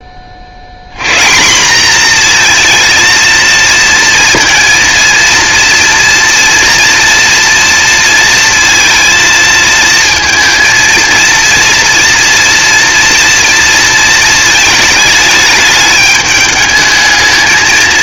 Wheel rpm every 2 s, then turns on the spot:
110, 230, 230, 230, 230, 230, 240, 210, 220.
none